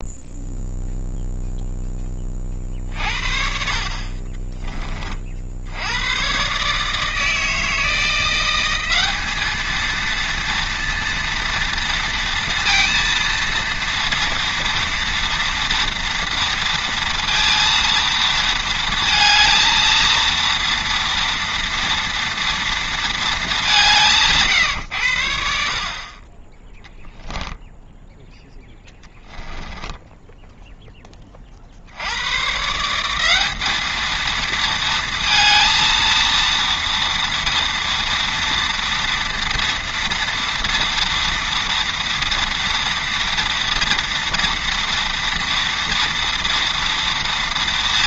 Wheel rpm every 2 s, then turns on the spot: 0, 40, 20, 140, 190, 230, 230, 230, 230, 230, 230, 230, 140, 20, 10, 10, 140, 230, 230, 230, 230, 230, 230, 230.
4-6 28-30